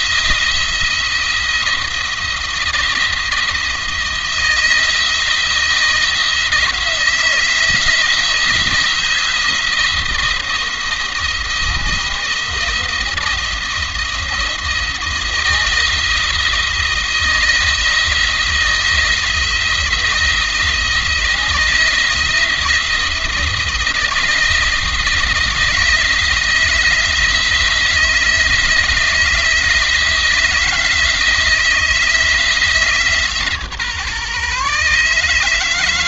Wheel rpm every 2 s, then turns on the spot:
170, 170, 170, 160, 170, 170, 160, 160, 160, 170, 170, 170, 170, 170, 160, 160, 160, 150.
none